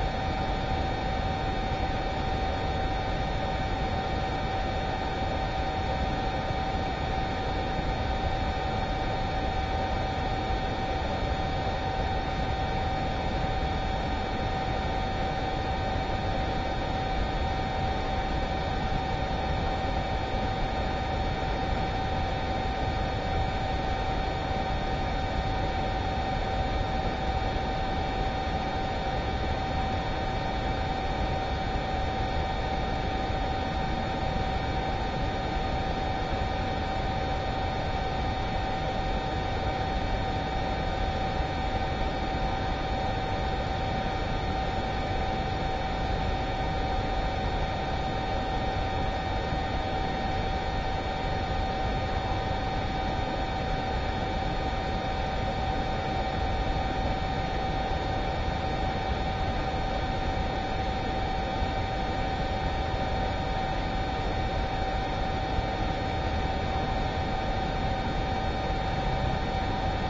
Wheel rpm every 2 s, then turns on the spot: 0, 0, 0, 0, 0, 0, 0, 0, 0, 0, 0, 0, 0, 0, 0, 0, 0, 0, 0, 0, 0, 0, 0, 0, 0, 0, 0, 0, 0, 0, 0, 0, 0, 0, 0.
none